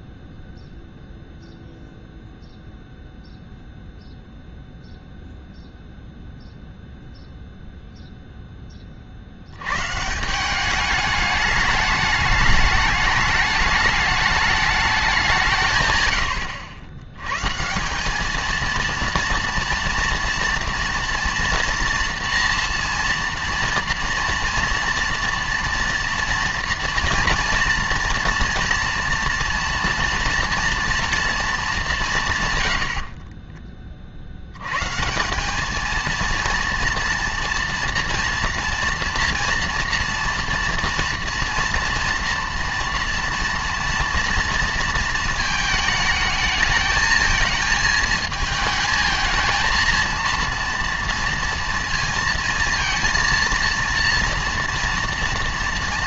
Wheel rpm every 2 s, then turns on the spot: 0, 0, 0, 0, 10, 190, 210, 210, 80, 230, 230, 230, 230, 240, 230, 230, 110, 110, 230, 230, 230, 240, 230, 220, 220, 230, 230, 230.
none